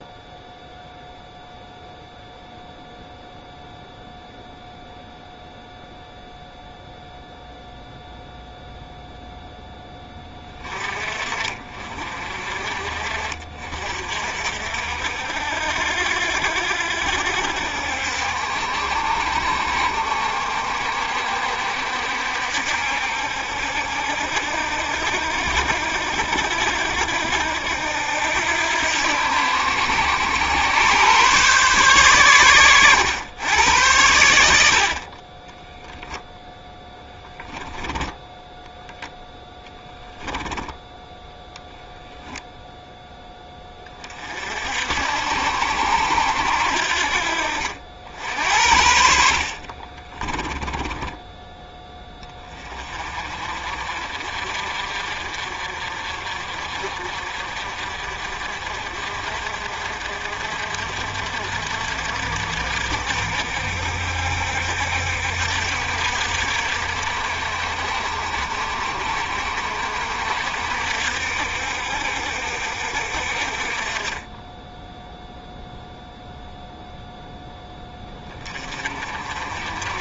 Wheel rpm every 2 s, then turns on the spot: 0, 0, 0, 0, 0, 30, 50, 60, 60, 60, 60, 60, 70, 70, 80, 110, 110, 50, 10, 0, 10, 0, 60, 70, 60, 20, 30, 50, 50, 50, 50, 60, 60, 60, 60, 60, 60, 10, 0, 30.
36-38 50-52